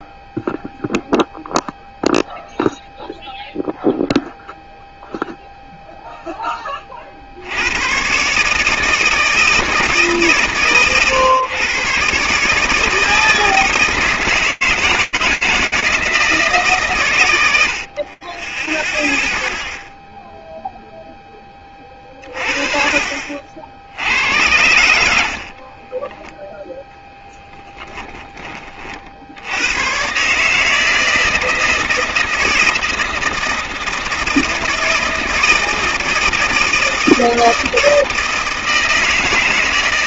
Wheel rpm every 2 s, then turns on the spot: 0, 0, 0, 40, 160, 130, 160, 160, 130, 0, 10, 50, 60, 0, 60, 160, 160, 160, 160, 160.
22-26